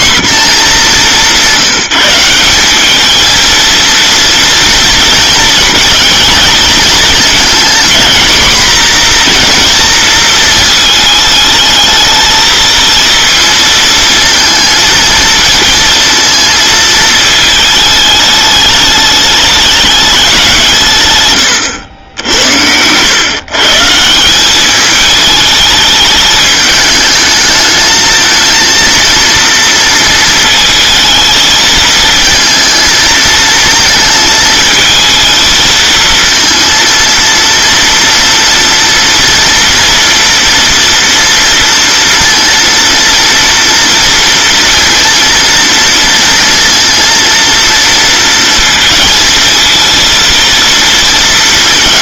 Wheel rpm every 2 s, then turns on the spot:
220, 190, 230, 230, 240, 220, 220, 220, 220, 210, 170, 90, 200, 210, 230, 220, 220, 220, 230, 230, 240, 230, 230, 230, 230, 230.
none